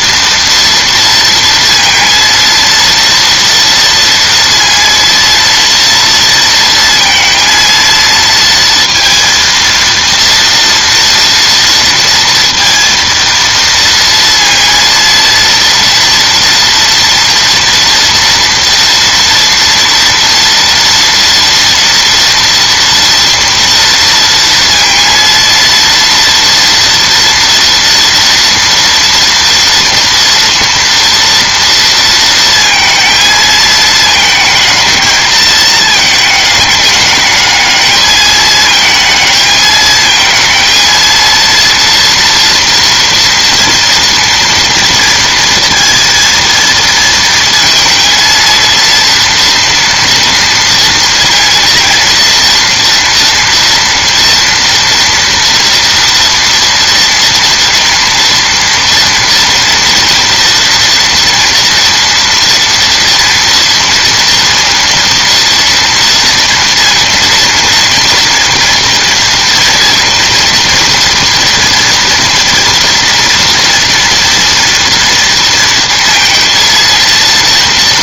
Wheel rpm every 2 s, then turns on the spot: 230, 230, 230, 230, 230, 230, 230, 230, 230, 230, 230, 230, 230, 230, 230, 230, 230, 220, 210, 220, 220, 230, 230, 230, 230, 230, 230, 230, 230, 230, 230, 230, 230, 230, 230, 240, 230, 230, 230.
none